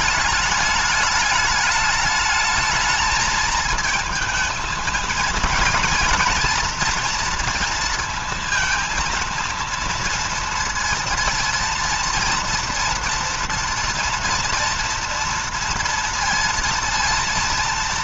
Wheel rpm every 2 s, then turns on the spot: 210, 220, 220, 230, 230, 230, 230, 240, 230.
none